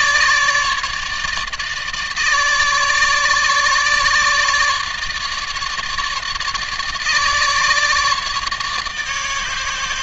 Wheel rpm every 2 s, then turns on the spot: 150, 150, 150, 150, 150.
none